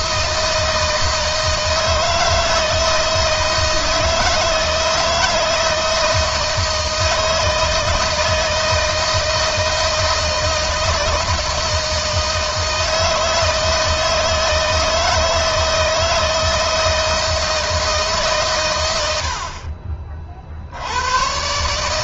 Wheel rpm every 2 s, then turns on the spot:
160, 160, 160, 160, 160, 160, 160, 160, 160, 100, 80.
none